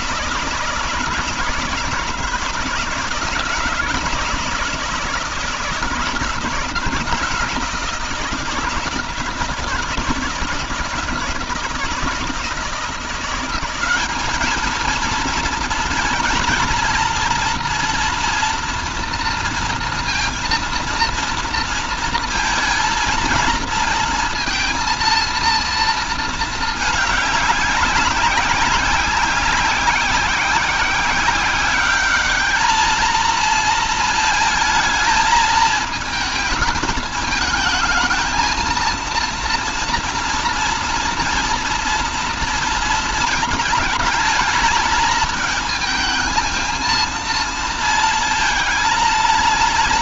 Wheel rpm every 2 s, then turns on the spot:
170, 170, 160, 170, 160, 160, 160, 220, 230, 240, 230, 230, 230, 220, 200, 190, 210, 220, 220, 220, 230, 230, 220, 220, 220.
none